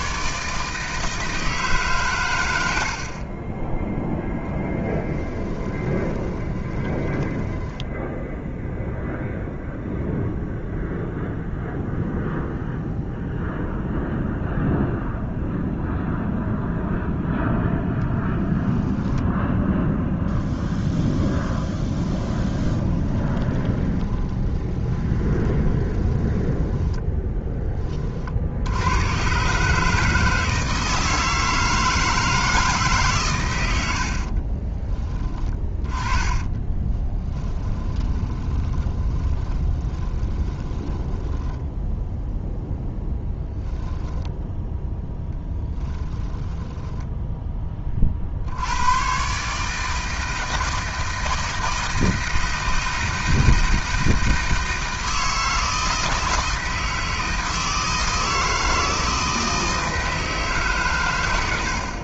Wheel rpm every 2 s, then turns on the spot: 160, 50, 10, 20, 0, 0, 0, 0, 0, 0, 10, 20, 20, 10, 100, 160, 140, 20, 20, 20, 10, 0, 10, 20, 110, 160, 160, 160, 160, 160, 110.
4-8 22-28 36-42 44-48